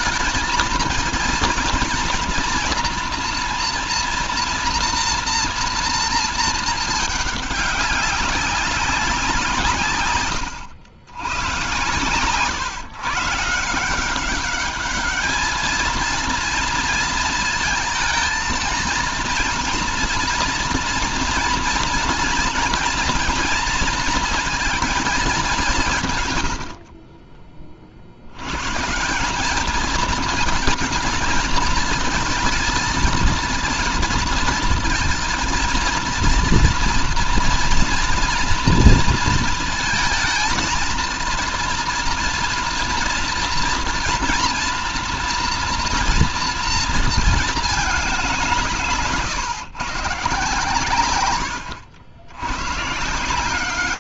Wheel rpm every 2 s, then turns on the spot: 220, 240, 240, 220, 200, 110, 130, 210, 230, 230, 230, 230, 220, 60, 110, 230, 230, 230, 230, 230, 230, 230, 230, 230, 170, 130, 100.
none